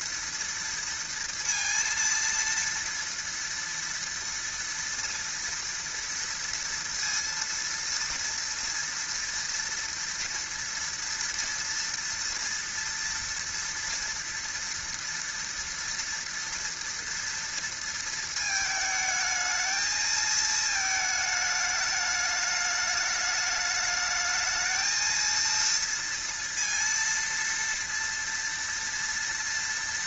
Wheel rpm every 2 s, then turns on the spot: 230, 230, 230, 230, 230, 230, 230, 230, 240, 220, 220, 210, 230, 230, 230.
none